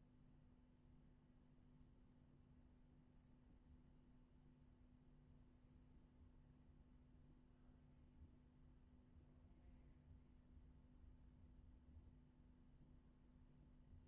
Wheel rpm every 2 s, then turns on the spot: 0, 0, 0, 0, 0, 0, 0.
none